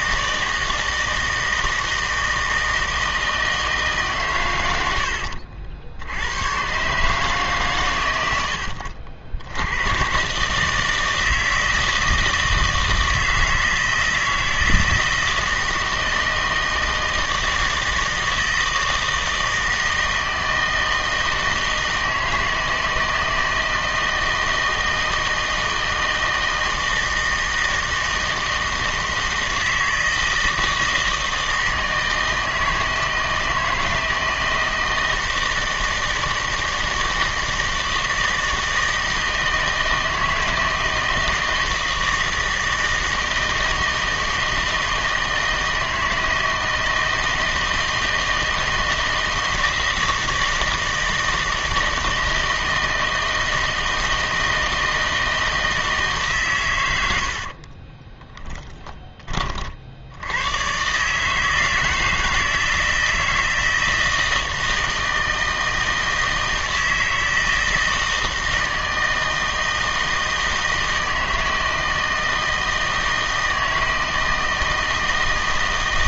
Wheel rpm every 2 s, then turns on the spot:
160, 160, 100, 120, 80, 160, 160, 160, 160, 160, 160, 160, 160, 160, 160, 160, 160, 160, 160, 160, 160, 160, 160, 160, 160, 160, 160, 160, 110, 20, 120, 160, 160, 160, 160, 160, 160, 160.
58-60